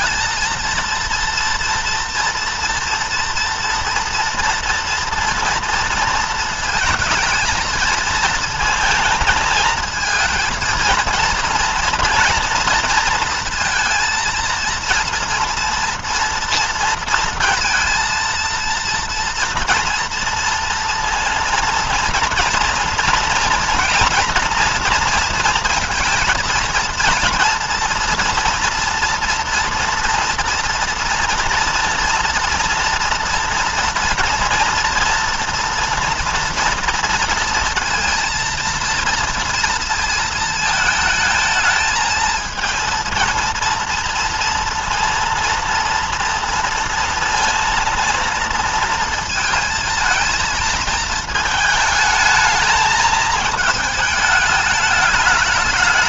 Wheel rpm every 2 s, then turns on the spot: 230, 230, 230, 230, 230, 230, 230, 230, 230, 230, 230, 230, 240, 230, 230, 230, 240, 230, 230, 230, 220, 230, 230, 230, 230, 220, 220, 210.
none